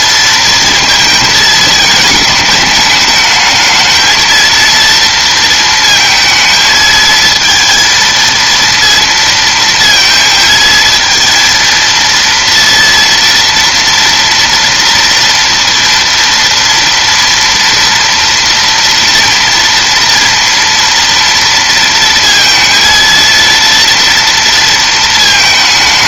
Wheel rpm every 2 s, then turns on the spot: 230, 210, 230, 220, 230, 220, 230, 230, 230, 230, 230, 230, 230.
none